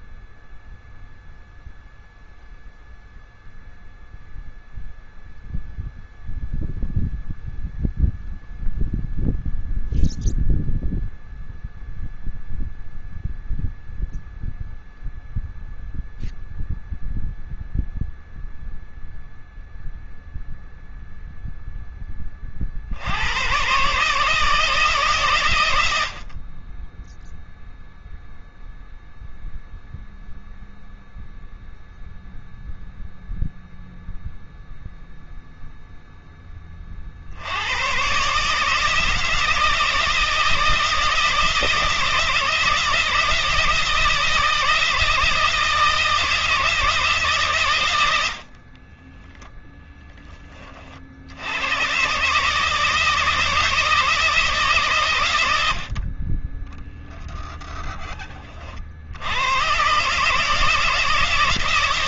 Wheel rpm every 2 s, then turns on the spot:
0, 0, 0, 0, 0, 0, 0, 0, 0, 0, 0, 110, 130, 0, 0, 0, 0, 0, 70, 160, 160, 160, 160, 150, 10, 60, 160, 100, 0, 70, 160.
48-50